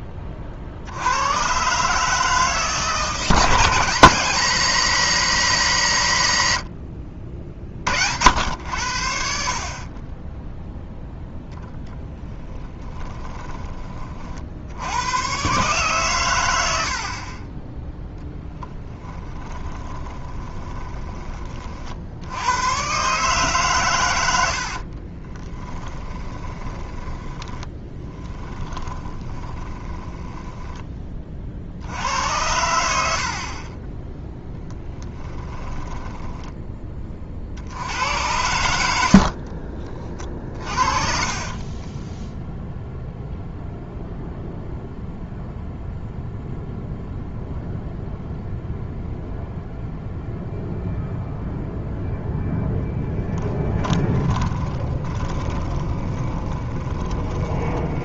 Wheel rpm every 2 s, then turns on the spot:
40, 150, 190, 80, 80, 0, 10, 80, 80, 10, 20, 120, 60, 20, 10, 10, 80, 10, 20, 80, 40, 0, 0, 0, 0, 0, 20, 30, 30.
12-14 20-22 24-30 34-36 40-42 52-58